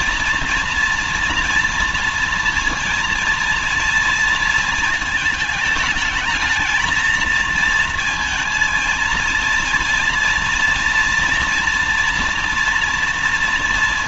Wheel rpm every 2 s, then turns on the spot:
230, 230, 220, 220, 230, 230, 240.
none